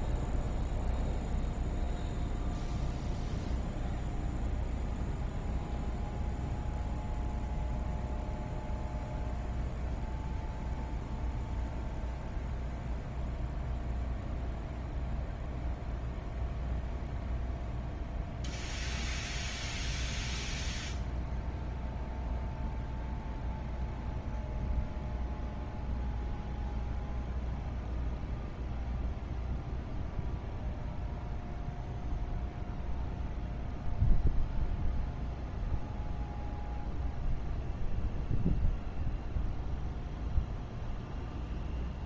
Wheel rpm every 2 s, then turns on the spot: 0, 0, 0, 0, 0, 0, 0, 0, 0, 0, 0, 0, 0, 0, 0, 0, 0, 0, 0, 0, 0.
none